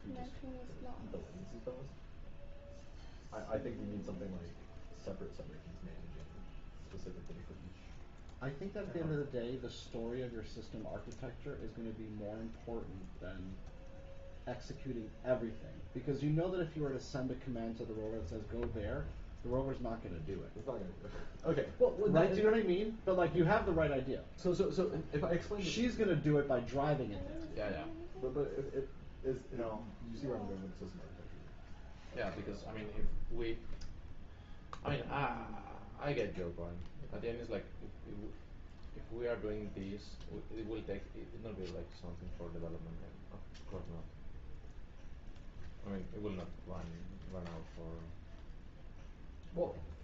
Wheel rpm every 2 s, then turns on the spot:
0, 0, 0, 0, 0, 0, 0, 0, 0, 0, 0, 0, 0, 0, 0, 0, 0, 0, 0, 0, 0, 0, 0, 0, 0.
none